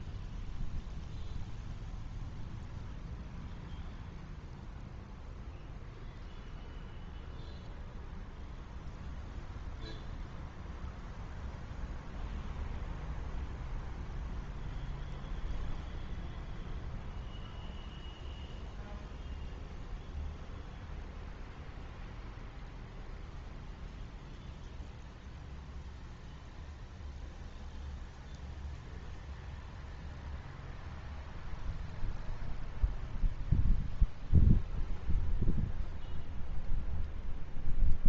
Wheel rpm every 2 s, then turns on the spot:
0, 0, 0, 0, 0, 0, 0, 0, 0, 0, 0, 0, 0, 0, 0, 0, 0, 0, 0.
none